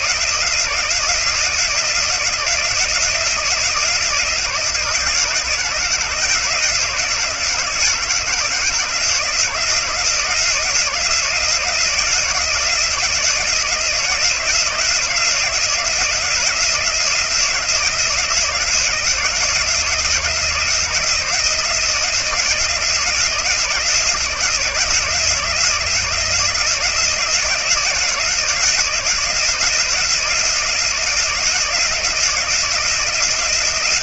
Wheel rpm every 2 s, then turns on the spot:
170, 170, 170, 170, 170, 170, 160, 170, 170, 160, 170, 170, 170, 170, 170, 170, 170.
none